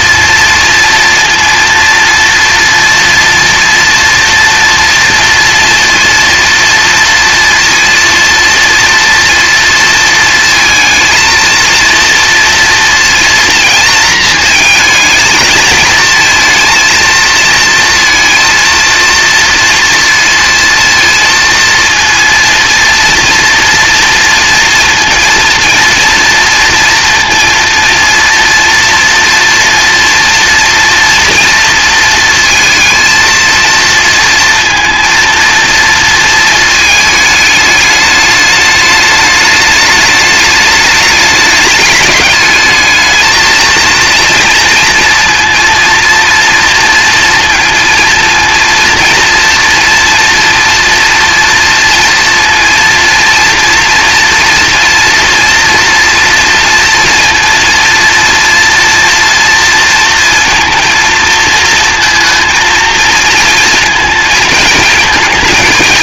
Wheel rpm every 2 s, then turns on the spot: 230, 230, 230, 230, 230, 230, 230, 220, 230, 230, 230, 230, 230, 230, 230, 240, 230, 230, 220, 210, 210, 220, 230, 230, 230, 230, 230, 230, 240, 230, 230, 230, 230.
none